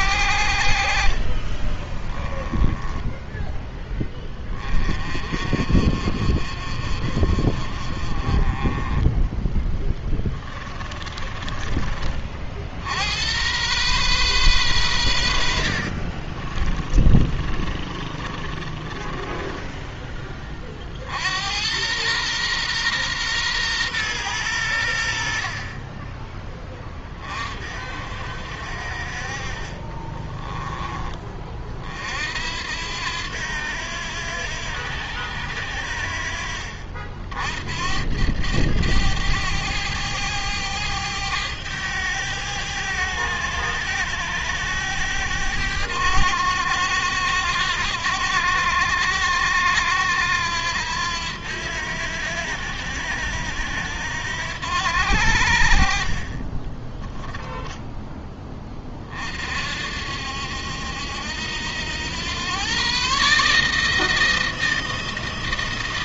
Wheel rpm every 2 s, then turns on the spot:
60, 10, 30, 40, 20, 20, 70, 110, 30, 20, 50, 120, 90, 20, 50, 20, 80, 80, 50, 100, 100, 100, 100, 90, 90, 90, 80, 80, 20, 30, 80, 130, 160.
0-4 10-12 16-20 56-58